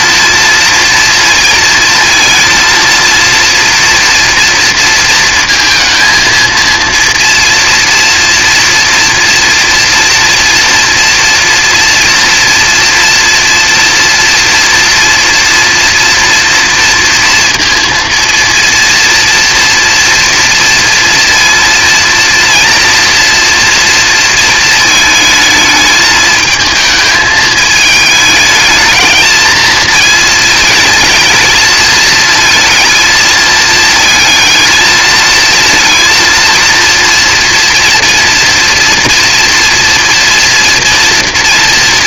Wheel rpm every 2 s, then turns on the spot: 230, 230, 230, 230, 230, 230, 230, 230, 230, 230, 230, 230, 230, 220, 220, 230, 220, 220, 230, 240, 230.
none